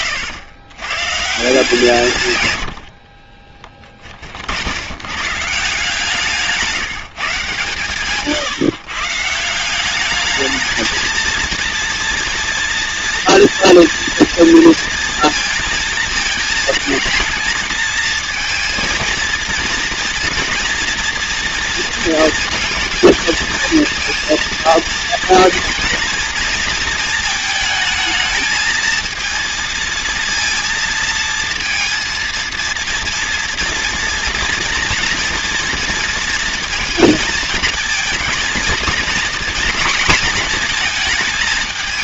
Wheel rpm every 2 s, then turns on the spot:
130, 50, 110, 150, 140, 220, 230, 230, 220, 230, 240, 230, 230, 220, 230, 230, 240, 240, 230, 230, 220.
2-4